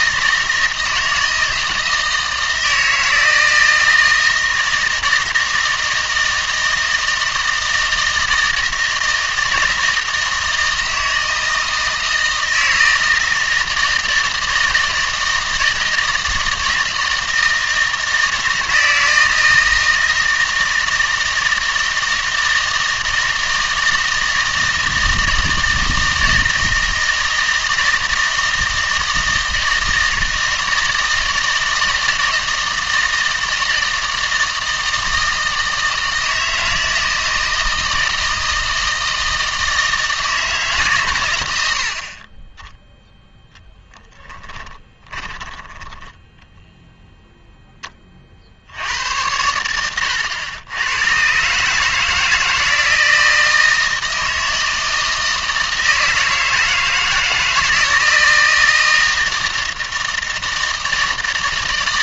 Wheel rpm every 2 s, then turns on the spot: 160, 160, 160, 160, 160, 160, 160, 160, 160, 160, 160, 160, 160, 160, 160, 160, 160, 160, 160, 160, 150, 10, 10, 10, 70, 100, 160, 160, 160, 160, 160.
44-46